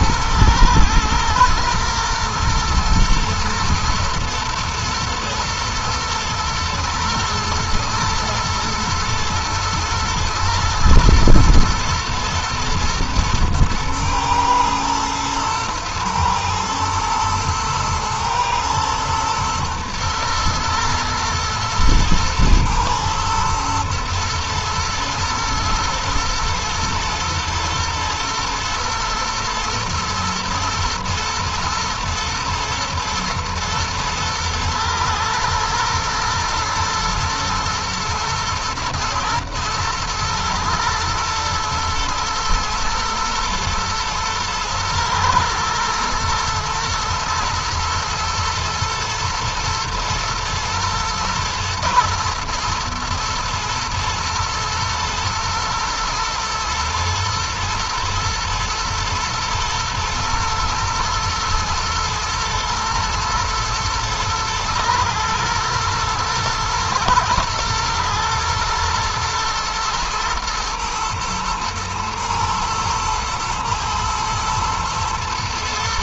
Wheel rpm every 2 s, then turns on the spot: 110, 120, 110, 110, 110, 120, 120, 110, 110, 110, 110, 110, 110, 120, 120, 120, 120, 110, 120, 120, 110, 120, 120, 110, 110, 110, 120, 120, 110, 110, 120, 110, 110, 120, 120, 120, 110, 110.
none